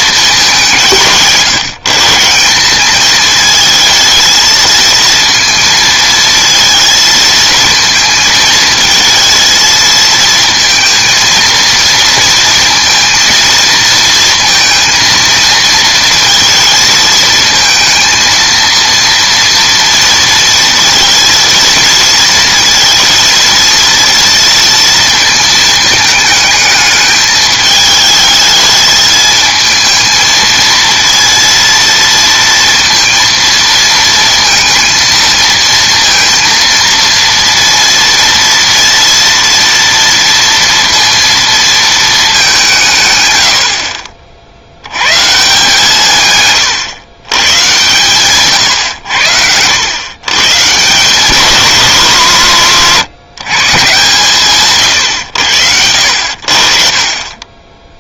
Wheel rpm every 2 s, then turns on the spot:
180, 200, 230, 230, 220, 230, 230, 230, 230, 230, 230, 230, 230, 210, 220, 230, 230, 230, 230, 230, 230, 180, 80, 120, 120, 140, 150, 140, 40.
none